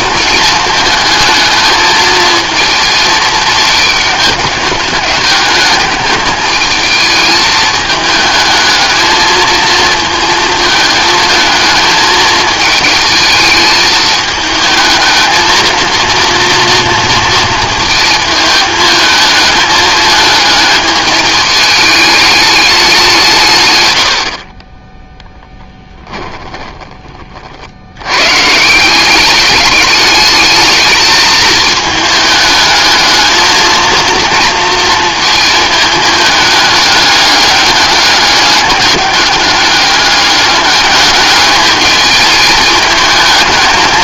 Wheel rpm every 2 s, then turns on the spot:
220, 230, 210, 220, 220, 220, 220, 220, 230, 220, 210, 210, 40, 10, 150, 210, 220, 230, 210, 200, 200, 220.
26-28